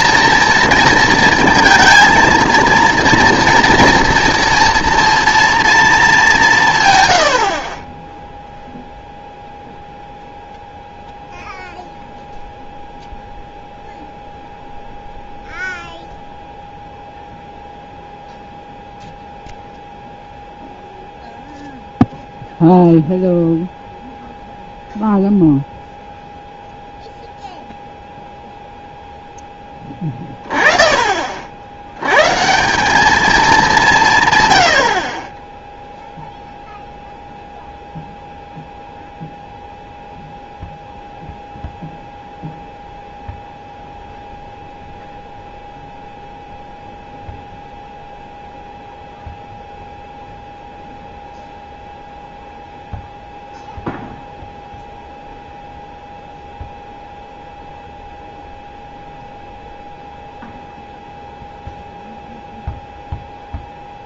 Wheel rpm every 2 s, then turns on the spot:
230, 230, 230, 160, 0, 0, 0, 0, 0, 0, 0, 0, 0, 0, 0, 20, 160, 100, 0, 0, 0, 0, 0, 0, 0, 0, 0, 0, 0, 0, 0, 0.
none